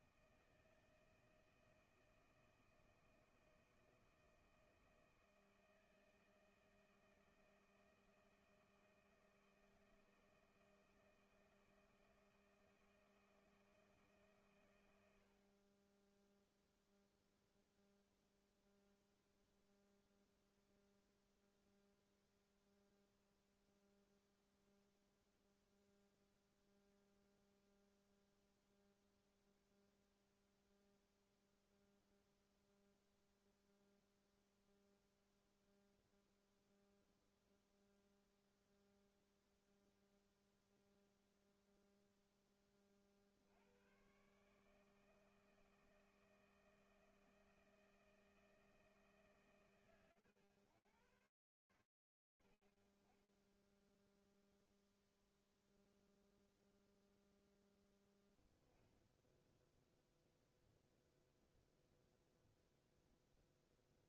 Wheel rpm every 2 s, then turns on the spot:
160, 160, 160, 160, 160, 160, 160, 110, 0, 0, 0, 0, 0, 0, 0, 0, 0, 0, 0, 0, 0, 10, 150, 160, 160, 60, 0, 0, 10, 0, 0, 0.
none